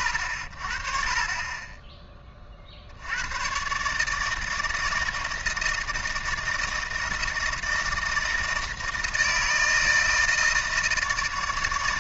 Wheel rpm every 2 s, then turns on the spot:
50, 50, 160, 160, 160, 160.
none